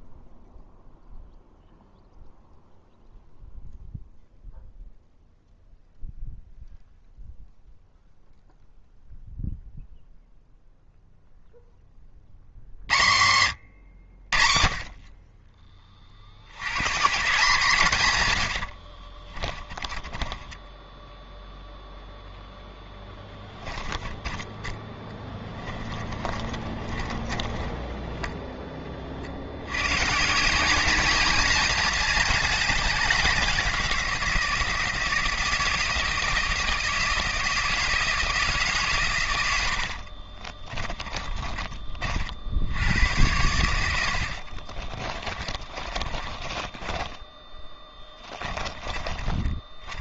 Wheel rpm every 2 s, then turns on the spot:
0, 0, 0, 0, 0, 0, 80, 40, 70, 80, 10, 0, 10, 20, 20, 180, 210, 160, 160, 150, 30, 70, 60, 20, 30.
18-22 26-28 40-42 44-50